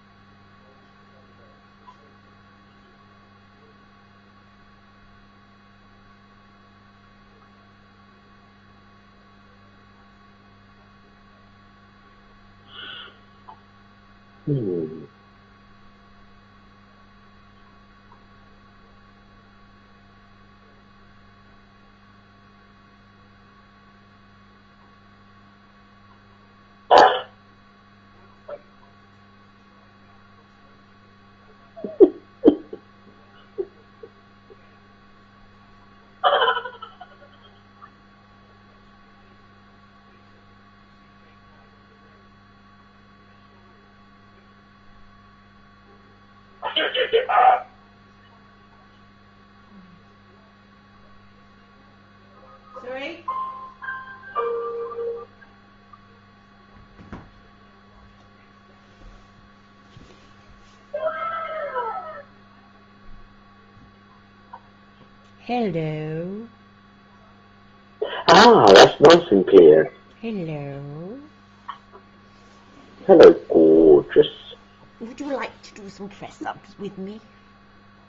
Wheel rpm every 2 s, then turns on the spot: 0, 0, 0, 0, 0, 0, 0, 0, 0, 0, 0, 0, 0, 0, 0, 0, 0, 0, 0, 0, 0, 0, 0, 0, 0, 0, 0, 0, 0, 0, 0, 0, 0, 0, 0, 0, 0, 0, 0.
none